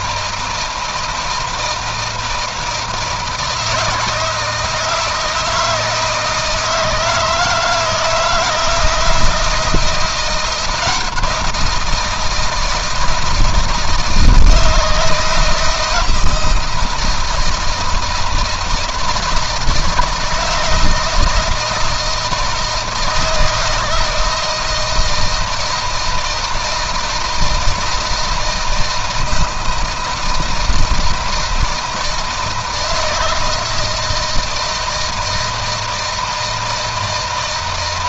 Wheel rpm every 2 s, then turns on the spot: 160, 160, 160, 160, 160, 170, 160, 160, 160, 160, 170, 160, 160, 170, 160, 160, 160, 160, 160.
none